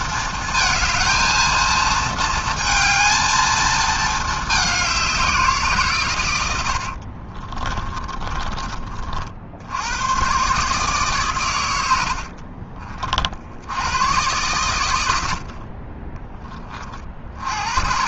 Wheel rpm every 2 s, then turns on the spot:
230, 230, 210, 80, 30, 140, 50, 110, 30.
6-8